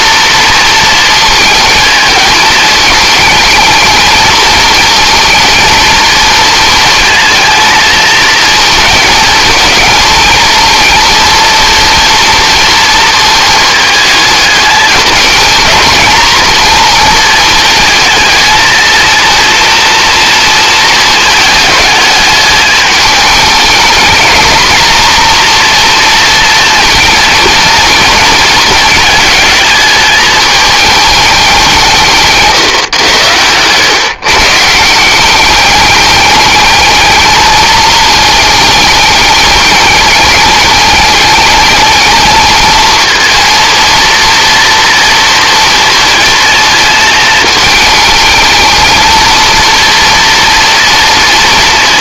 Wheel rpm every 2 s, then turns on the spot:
230, 220, 230, 230, 220, 230, 230, 220, 230, 230, 220, 210, 230, 230, 220, 220, 140, 160, 220, 210, 210, 220, 230, 220, 220, 230.
none